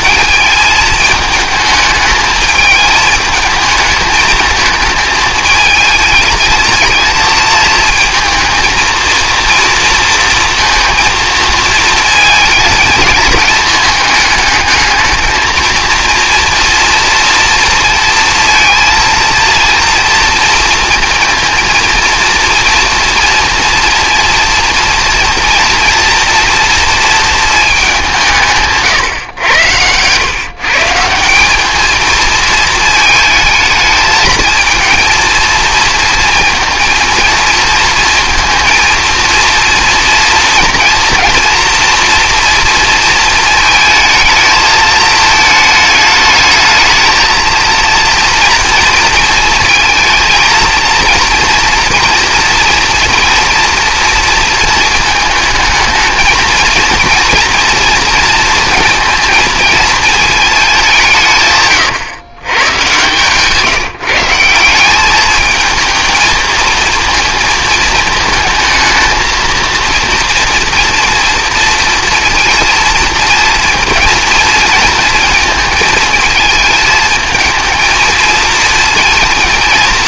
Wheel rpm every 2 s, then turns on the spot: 220, 220, 220, 220, 230, 230, 220, 220, 230, 230, 230, 230, 230, 230, 140, 170, 220, 230, 230, 230, 240, 230, 220, 220, 230, 230, 240, 220, 230, 230, 180, 120, 180, 220, 220, 240, 230, 230, 220, 230.
none